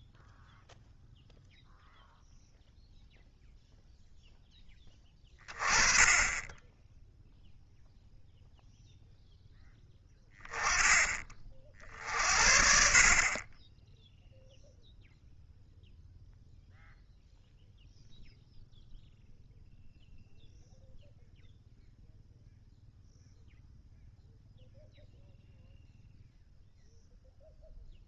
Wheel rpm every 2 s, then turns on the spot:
0, 0, 10, 10, 0, 10, 50, 0, 0, 0, 0, 0, 0, 0.
none